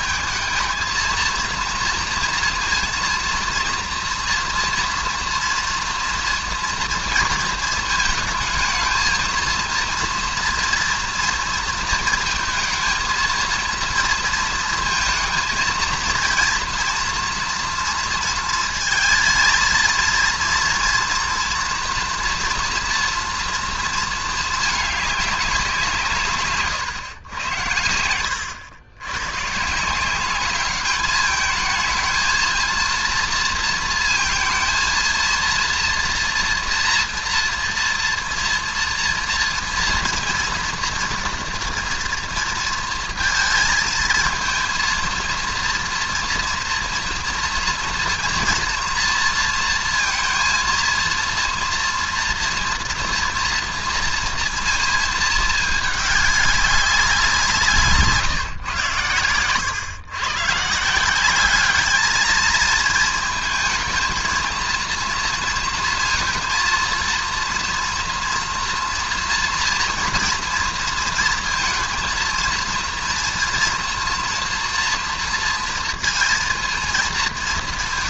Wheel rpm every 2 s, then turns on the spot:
220, 230, 240, 230, 220, 230, 220, 230, 230, 220, 230, 240, 220, 140, 100, 190, 230, 230, 240, 230, 230, 230, 230, 230, 230, 230, 240, 230, 200, 150, 130, 220, 230, 230, 230, 230, 230, 230, 230.
none